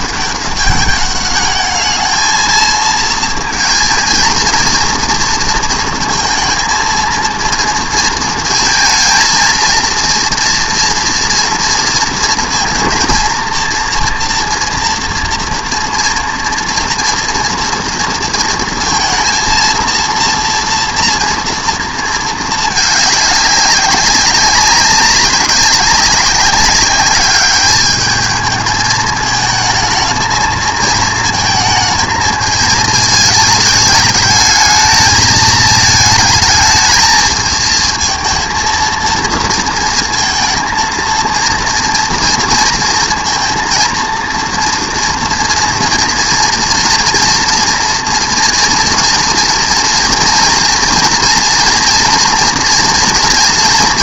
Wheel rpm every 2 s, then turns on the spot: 200, 220, 230, 230, 230, 230, 230, 230, 230, 230, 230, 220, 190, 200, 220, 220, 220, 220, 220, 230, 230, 230, 230, 230, 230, 230, 240.
none